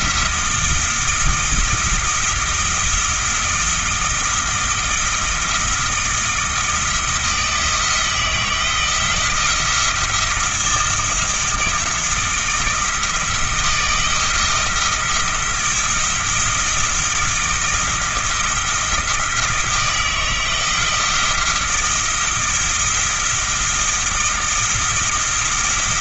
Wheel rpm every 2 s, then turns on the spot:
160, 170, 170, 160, 170, 170, 160, 170, 170, 170, 160, 170, 170.
none